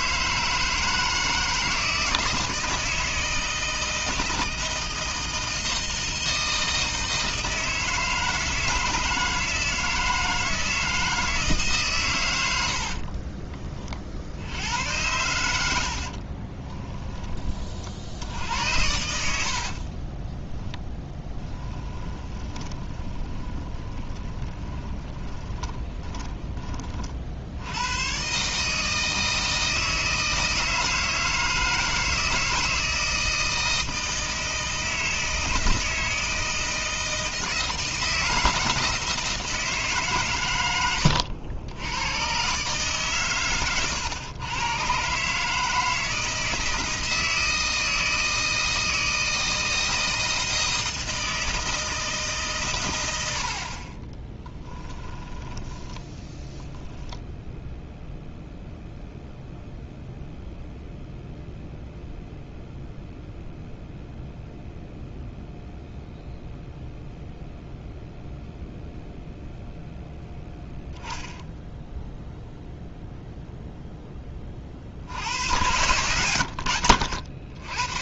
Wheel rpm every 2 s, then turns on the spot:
160, 160, 160, 160, 160, 160, 90, 80, 30, 90, 10, 20, 20, 30, 150, 160, 160, 160, 160, 160, 110, 140, 130, 160, 160, 160, 120, 10, 10, 0, 0, 0, 0, 0, 0, 10, 0, 40, 90.
16-18 20-28 54-56